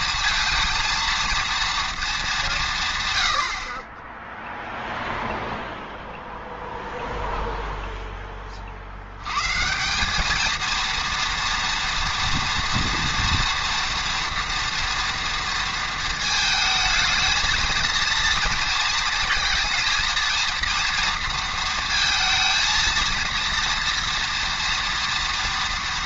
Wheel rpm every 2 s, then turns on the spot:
230, 170, 0, 0, 40, 220, 230, 230, 220, 230, 230, 230, 230.
none